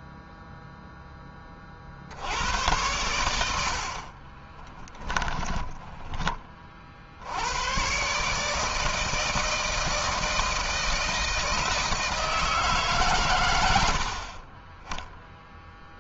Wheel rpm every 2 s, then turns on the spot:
0, 80, 20, 30, 150, 160, 160, 50.
4-6